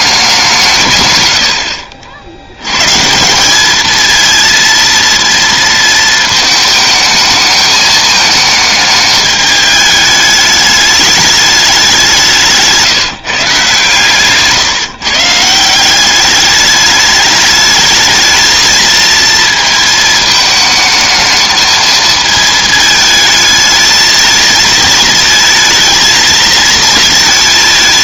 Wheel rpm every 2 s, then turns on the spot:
150, 110, 230, 220, 220, 210, 160, 140, 200, 230, 220, 220, 220, 220.
none